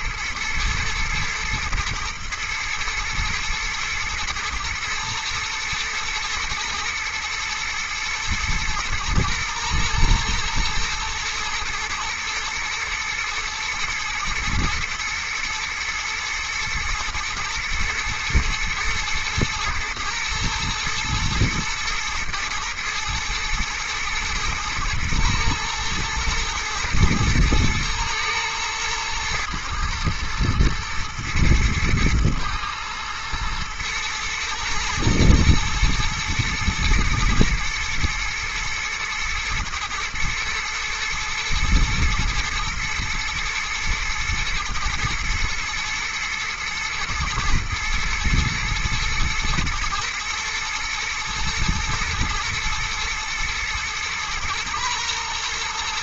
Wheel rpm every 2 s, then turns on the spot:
110, 120, 110, 110, 110, 120, 110, 110, 110, 120, 110, 110, 110, 110, 110, 110, 110, 110, 120, 120, 110, 110, 120, 120, 120, 120, 110, 120.
none